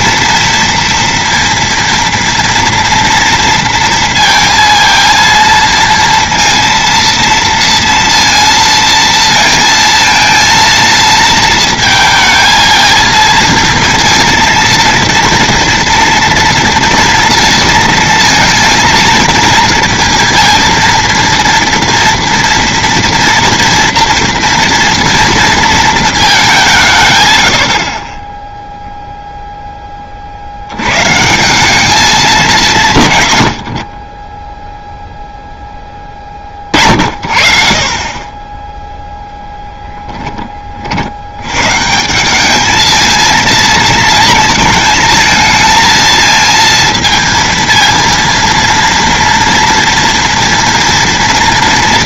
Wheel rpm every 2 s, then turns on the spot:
230, 230, 230, 230, 230, 230, 220, 230, 230, 230, 230, 230, 230, 190, 10, 80, 180, 0, 40, 20, 20, 200, 230, 230, 230, 230.
none